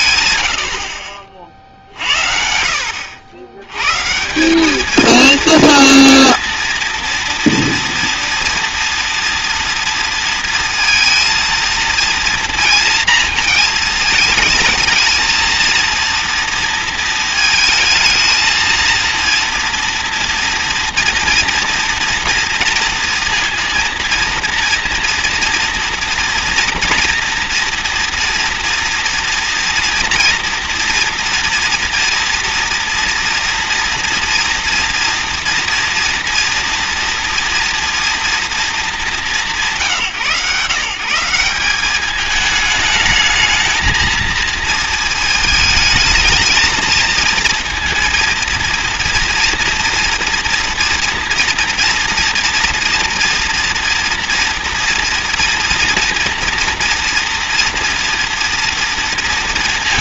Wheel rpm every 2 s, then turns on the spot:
120, 70, 180, 230, 230, 230, 230, 220, 230, 220, 240, 230, 230, 230, 230, 230, 230, 230, 230, 230, 150, 210, 230, 220, 230, 240, 230, 230, 230, 240.
none